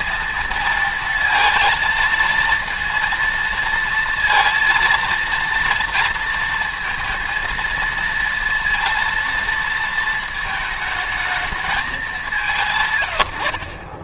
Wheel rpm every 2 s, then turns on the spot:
230, 230, 230, 230, 230, 220, 160.
none